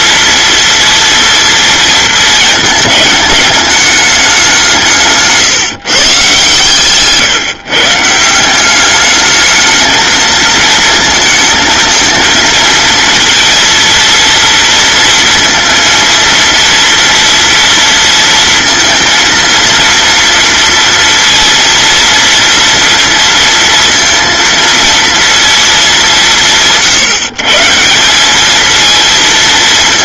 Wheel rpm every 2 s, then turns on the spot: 230, 220, 170, 140, 200, 230, 230, 230, 230, 230, 230, 230, 230, 150, 220.
none